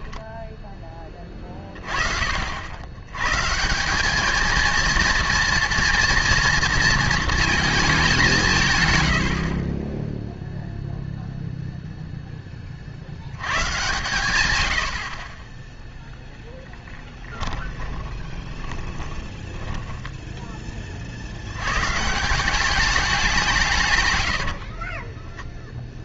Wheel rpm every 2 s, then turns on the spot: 10, 90, 230, 230, 110, 0, 40, 110, 10, 20, 20, 190, 40.
16-20 24-26